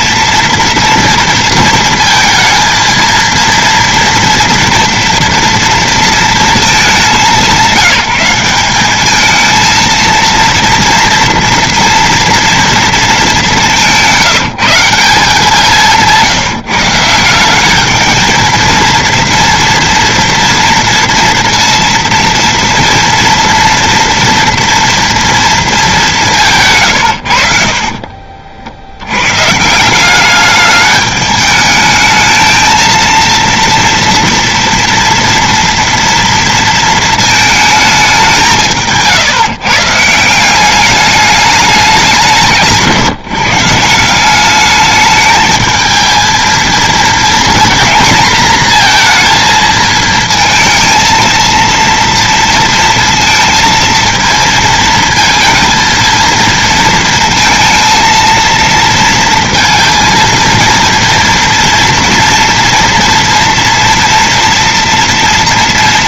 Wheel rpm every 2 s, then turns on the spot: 230, 230, 230, 230, 180, 230, 230, 170, 160, 220, 230, 230, 230, 190, 40, 190, 220, 240, 230, 200, 160, 180, 180, 220, 230, 230, 230, 230, 230, 230, 230, 230, 230.
28-30